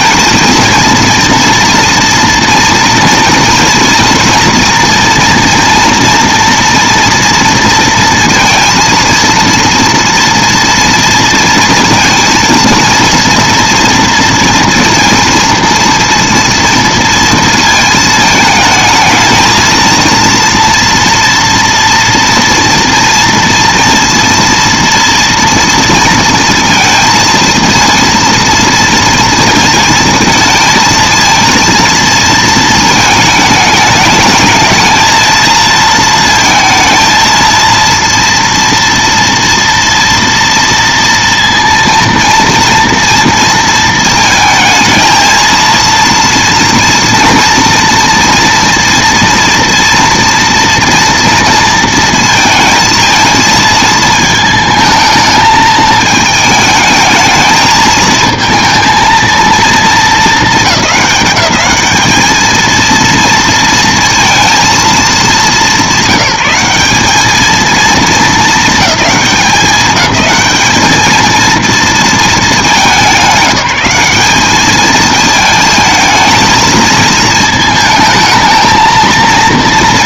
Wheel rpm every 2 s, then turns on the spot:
230, 230, 230, 240, 230, 230, 230, 230, 230, 220, 230, 230, 230, 230, 230, 220, 230, 220, 220, 230, 230, 230, 230, 230, 230, 230, 230, 220, 220, 220, 210, 220, 220, 180, 220, 210, 220, 210, 220, 220.
none